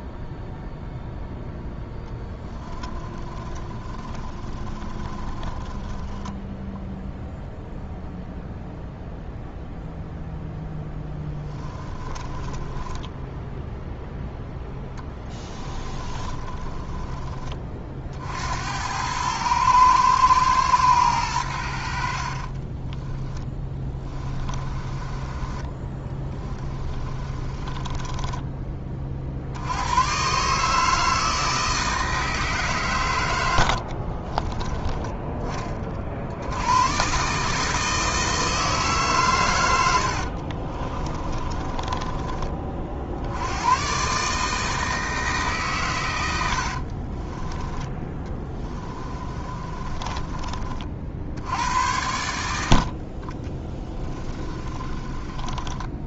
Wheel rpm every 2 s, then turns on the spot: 0, 20, 20, 0, 0, 10, 10, 10, 20, 90, 110, 20, 30, 20, 30, 150, 120, 20, 120, 150, 30, 50, 160, 40, 20, 30, 40, 20.
2-6 12-18 22-28 34-36 40-42 46-50 54-56